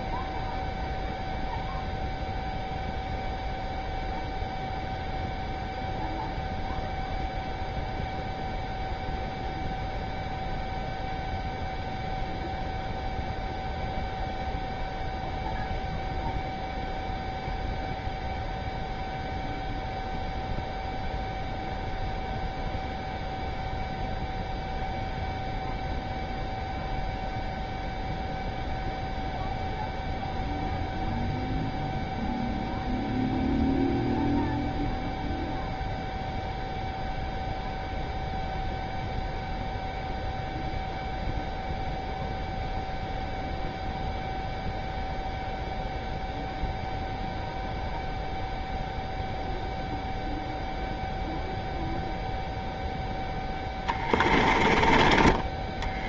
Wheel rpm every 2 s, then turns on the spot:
0, 0, 0, 0, 0, 0, 0, 0, 0, 0, 0, 0, 0, 0, 0, 0, 0, 0, 0, 0, 0, 0, 0, 0, 0, 0, 0, 20.
54-56